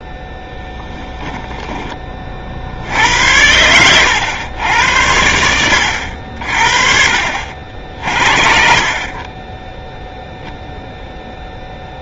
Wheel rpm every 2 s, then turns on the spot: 10, 70, 100, 50, 50, 0.
0-2